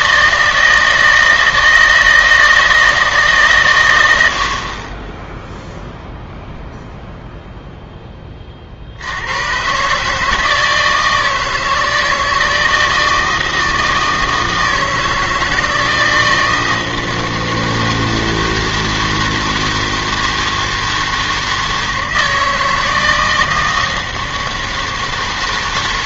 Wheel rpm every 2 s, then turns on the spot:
160, 160, 40, 0, 50, 160, 160, 160, 160, 160, 160, 160, 160.
none